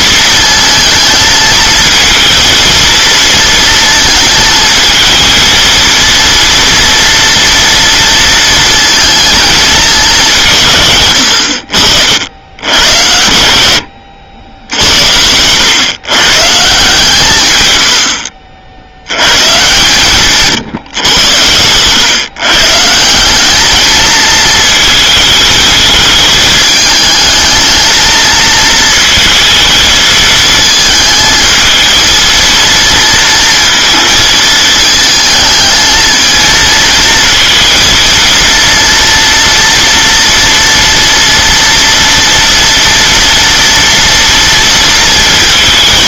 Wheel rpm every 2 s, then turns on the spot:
220, 220, 220, 230, 230, 150, 80, 70, 150, 60, 140, 140, 230, 220, 230, 220, 230, 220, 220, 230, 230, 240, 230.
none